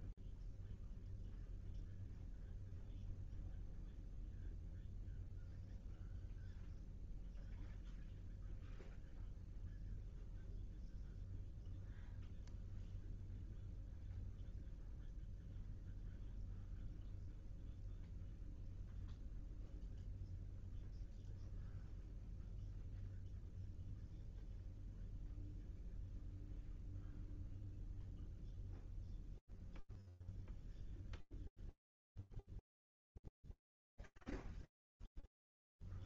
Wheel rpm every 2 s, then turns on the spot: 0, 0, 0, 0, 0, 0, 0, 0, 0, 0, 0, 0, 0, 0, 0, 0, 0, 0.
none